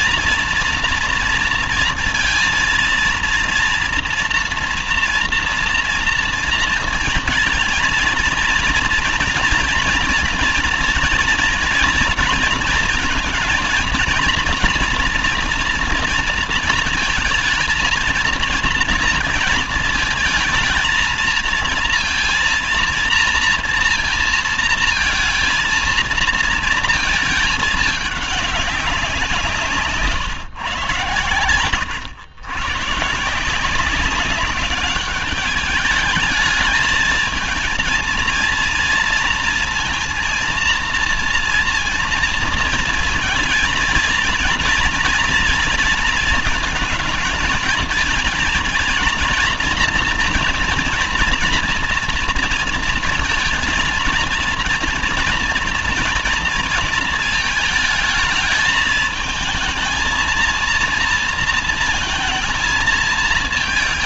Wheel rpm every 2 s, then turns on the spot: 230, 230, 230, 230, 240, 230, 230, 240, 230, 220, 220, 230, 230, 230, 200, 130, 130, 200, 220, 230, 230, 220, 230, 220, 220, 240, 230, 230, 230, 220, 230, 220.
none